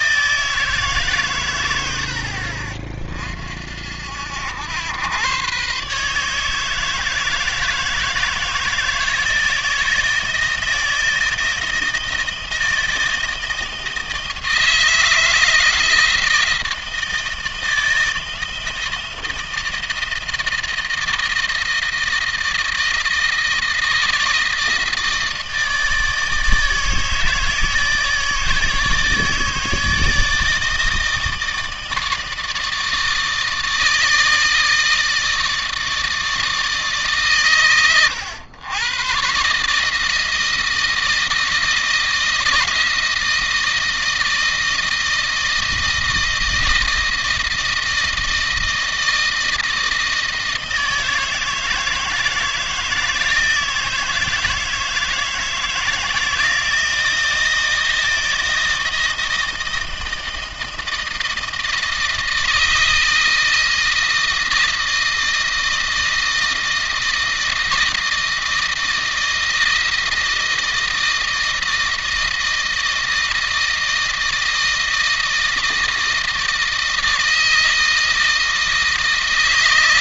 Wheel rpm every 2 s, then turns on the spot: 150, 50, 100, 160, 160, 160, 170, 160, 160, 160, 160, 160, 160, 160, 160, 160, 160, 160, 150, 120, 160, 160, 160, 160, 160, 160, 160, 160, 160, 160, 160, 160, 160, 160, 160, 160, 160, 160, 160, 160.
none